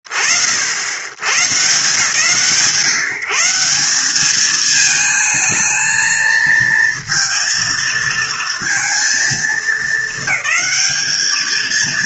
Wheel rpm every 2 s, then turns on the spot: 60, 160, 220, 230, 230, 220.
none